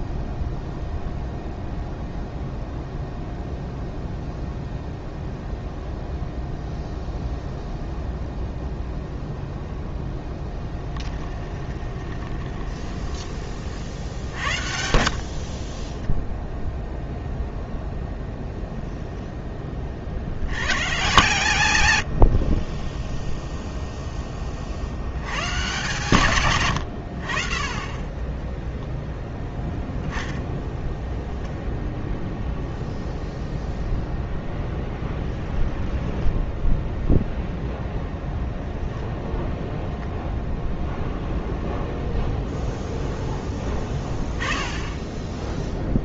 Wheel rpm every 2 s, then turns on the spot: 0, 0, 0, 0, 0, 10, 20, 50, 0, 0, 60, 10, 70, 90, 0, 0, 0, 10, 0, 0, 0, 0, 10.
10-16 34-36